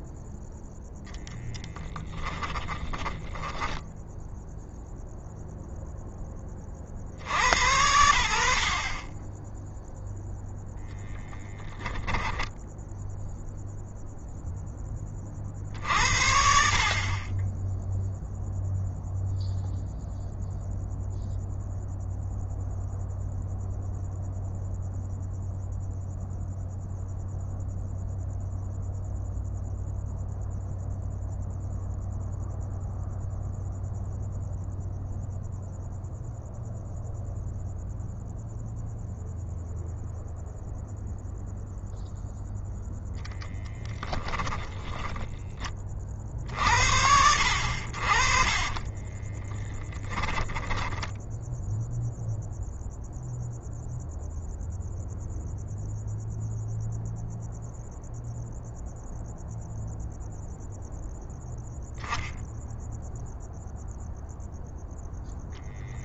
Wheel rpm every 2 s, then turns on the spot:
0, 30, 0, 50, 40, 0, 0, 30, 30, 0, 0, 0, 0, 0, 0, 0, 0, 0, 0, 0, 0, 0, 10, 70, 30, 10, 0, 0, 0, 0, 0, 0, 0.
2-4 48-50